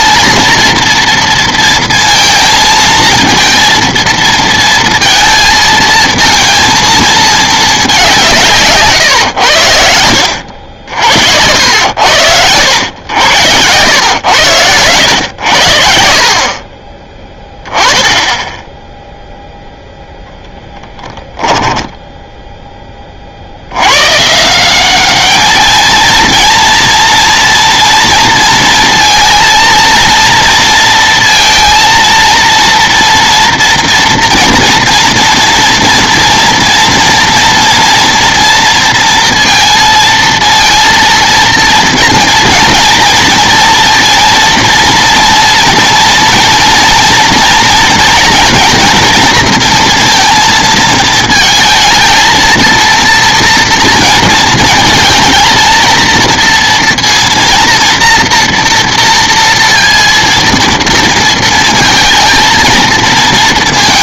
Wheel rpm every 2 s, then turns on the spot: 230, 220, 230, 220, 140, 70, 90, 90, 40, 10, 0, 10, 180, 240, 230, 230, 230, 240, 230, 230, 230, 230, 230, 230, 230, 230, 230, 230, 230, 230, 230, 220.
none